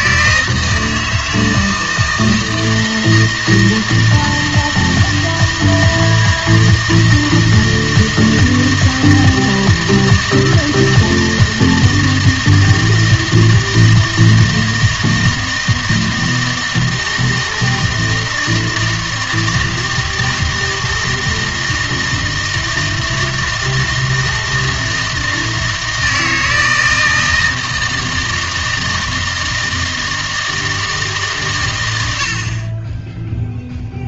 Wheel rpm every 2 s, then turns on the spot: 160, 160, 160, 160, 160, 160, 160, 160, 160, 160, 160, 160, 160, 160, 160, 160, 40.
none